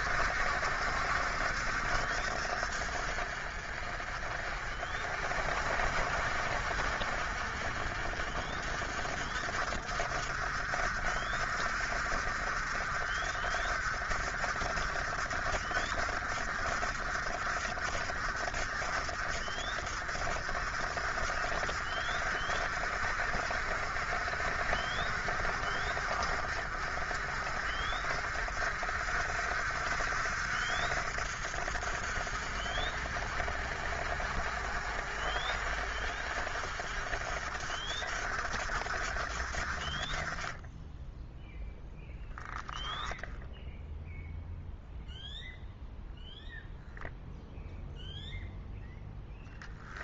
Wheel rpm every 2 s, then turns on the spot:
60, 60, 50, 60, 60, 50, 50, 50, 50, 50, 50, 50, 60, 50, 50, 60, 50, 50, 50, 50, 20, 0, 0, 0, 0.
none